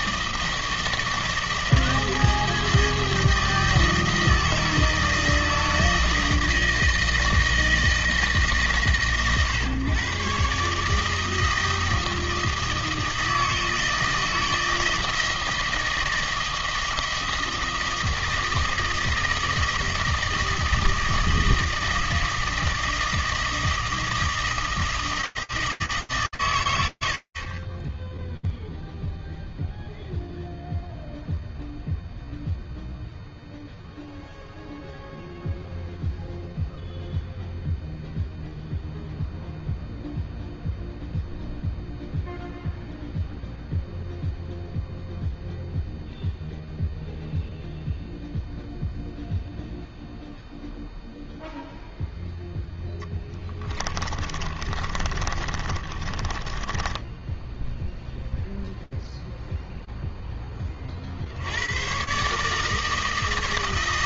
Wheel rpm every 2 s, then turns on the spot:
160, 160, 160, 160, 150, 140, 160, 160, 160, 160, 160, 160, 160, 110, 0, 0, 0, 0, 0, 0, 0, 0, 0, 0, 0, 0, 40, 30, 0, 10, 150, 140.
52-56